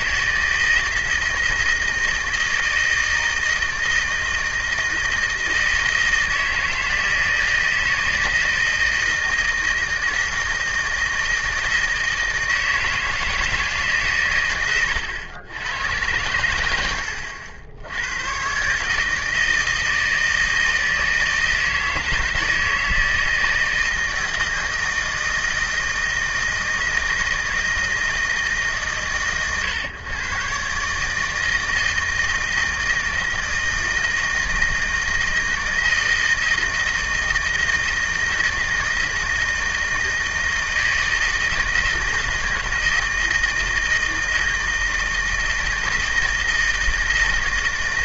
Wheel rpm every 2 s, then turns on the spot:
160, 170, 160, 160, 160, 160, 160, 110, 80, 140, 160, 160, 160, 160, 130, 140, 160, 160, 160, 160, 160, 160, 160, 160.
none